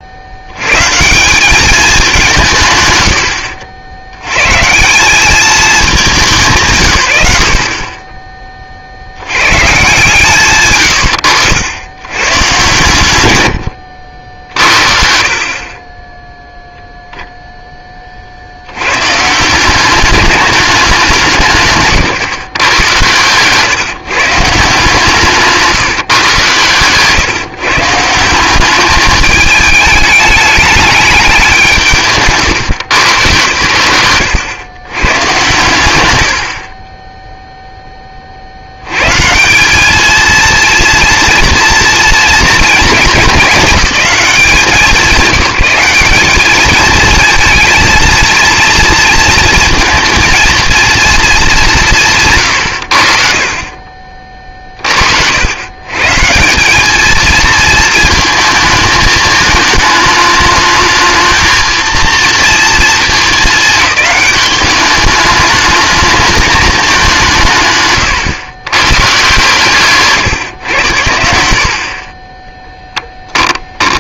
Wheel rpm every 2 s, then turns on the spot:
130, 90, 170, 140, 50, 120, 110, 60, 0, 100, 200, 130, 150, 130, 200, 210, 140, 130, 50, 70, 230, 230, 190, 220, 230, 230, 100, 40, 200, 220, 210, 220, 200, 200, 120, 110, 10.
26-28 72-74